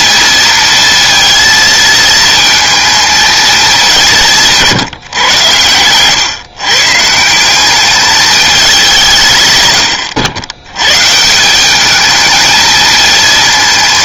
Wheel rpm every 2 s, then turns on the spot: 230, 230, 150, 140, 190, 100, 220.
none